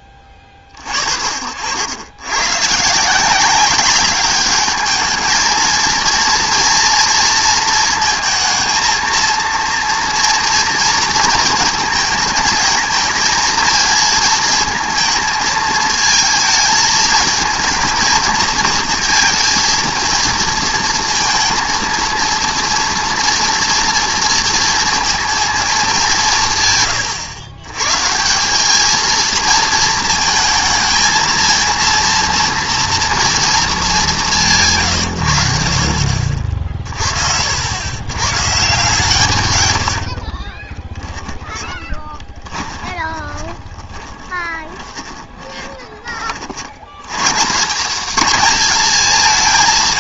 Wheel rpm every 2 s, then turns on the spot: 40, 140, 210, 230, 220, 230, 220, 220, 220, 230, 230, 230, 230, 130, 210, 230, 230, 150, 40, 140, 20, 20, 20, 80, 200.
40-46